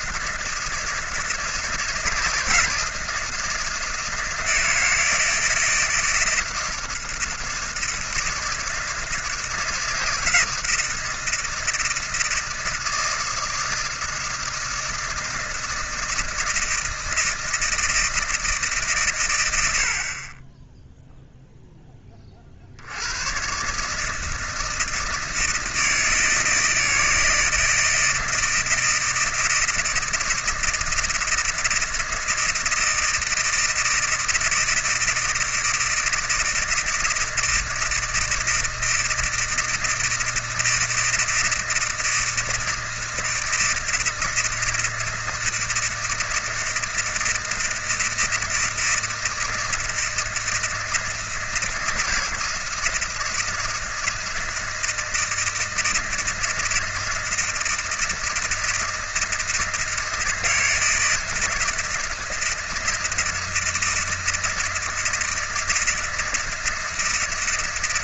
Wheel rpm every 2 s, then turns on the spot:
160, 160, 160, 160, 160, 160, 160, 160, 160, 150, 20, 70, 160, 160, 160, 160, 160, 160, 160, 160, 160, 160, 160, 160, 160, 160, 160, 160, 160, 160, 160, 160, 160, 160.
none